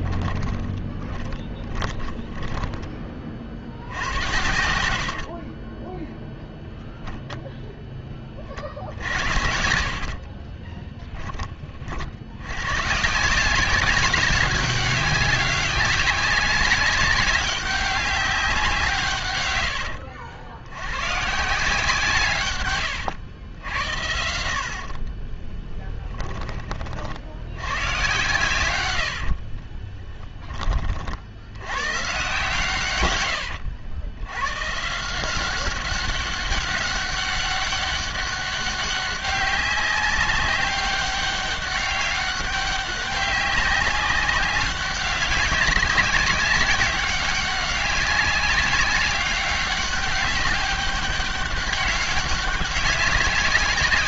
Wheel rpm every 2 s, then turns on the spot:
30, 20, 70, 0, 60, 20, 130, 200, 190, 160, 110, 110, 40, 50, 100, 40, 120, 160, 200, 190, 200, 200, 200, 200, 200, 200, 190.
0-2 10-12 22-26 28-30